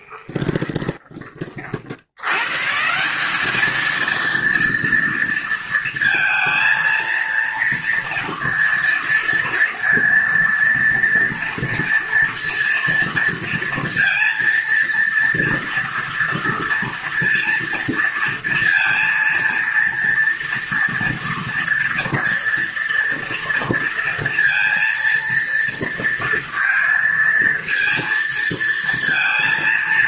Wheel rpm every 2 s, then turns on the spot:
20, 140, 230, 230, 230, 230, 230, 230, 240, 230, 230, 230, 230, 230, 230.
0-2